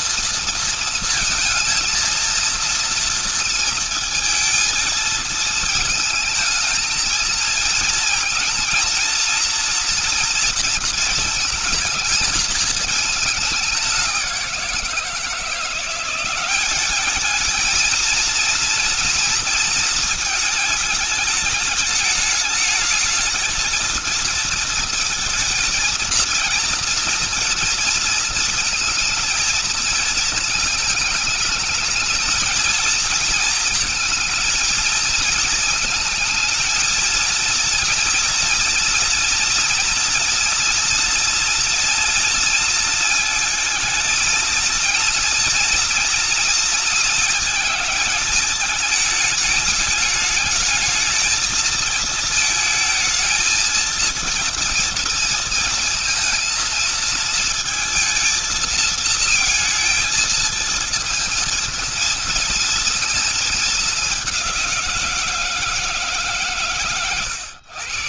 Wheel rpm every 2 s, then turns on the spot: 230, 230, 230, 220, 230, 230, 220, 180, 190, 230, 220, 210, 230, 230, 230, 220, 220, 220, 220, 230, 230, 230, 220, 230, 220, 210, 220, 230, 230, 220, 220, 230, 190, 140.
none